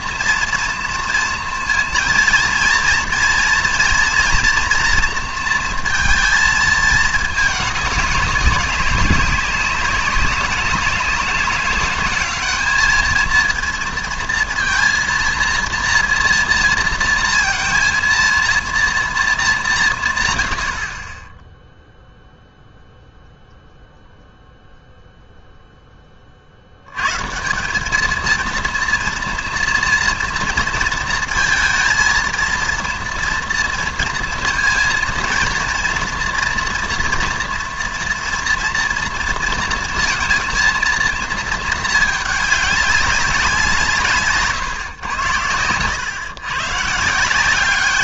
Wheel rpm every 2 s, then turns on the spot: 240, 230, 240, 220, 200, 200, 210, 230, 230, 230, 80, 0, 0, 70, 230, 230, 230, 230, 230, 230, 230, 200, 130, 130.
none